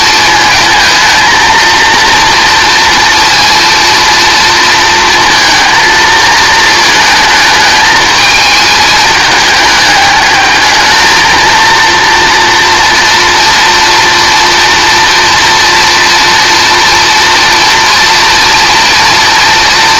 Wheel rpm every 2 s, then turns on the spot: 230, 230, 230, 220, 220, 220, 230, 230, 230, 240.
none